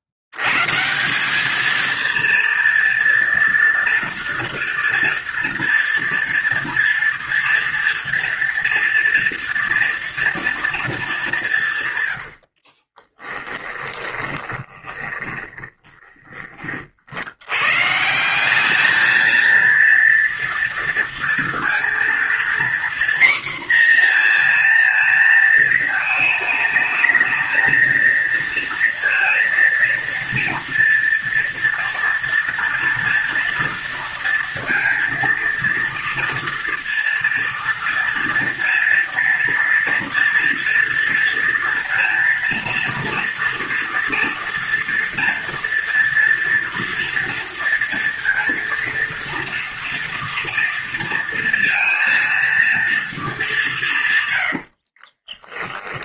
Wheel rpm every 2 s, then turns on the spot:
70, 230, 240, 230, 230, 230, 70, 20, 30, 190, 230, 240, 240, 220, 230, 230, 230, 230, 230, 240, 230, 230, 230, 230, 230, 230, 230, 100.
12-16 54-56